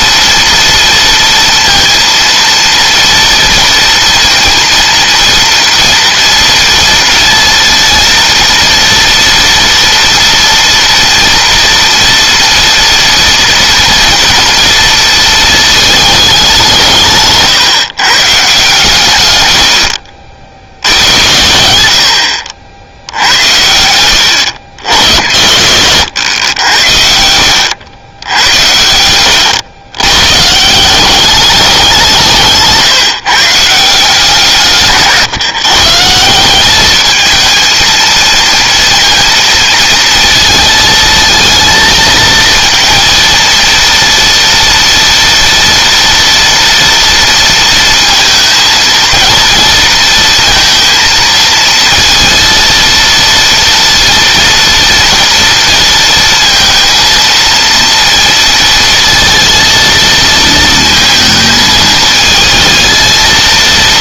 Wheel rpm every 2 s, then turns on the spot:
230, 230, 230, 230, 230, 230, 230, 230, 170, 140, 80, 80, 80, 80, 90, 180, 160, 150, 210, 230, 220, 230, 230, 230, 220, 230, 230, 240, 230, 230, 220, 230.
none